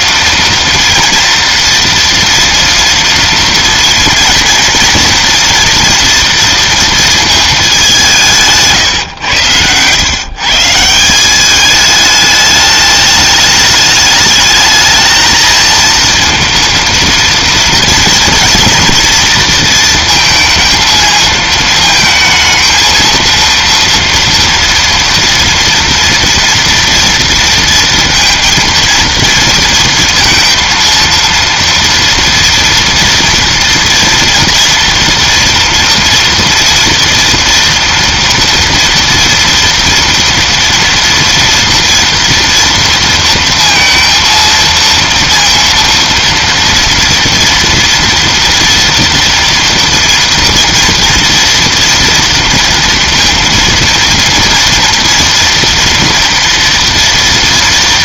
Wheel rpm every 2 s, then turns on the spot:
230, 230, 230, 230, 150, 160, 210, 220, 230, 230, 230, 220, 230, 230, 230, 230, 230, 230, 230, 230, 230, 230, 230, 230, 230, 230, 230, 230, 230.
none